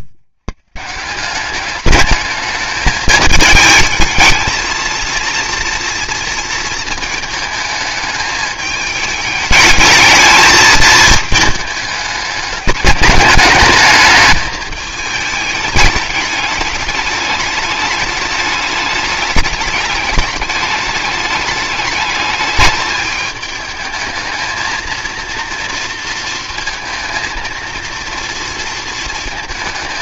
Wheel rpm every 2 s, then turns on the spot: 130, 210, 220, 220, 210, 220, 200, 220, 210, 210, 210, 210, 220, 230, 230.
none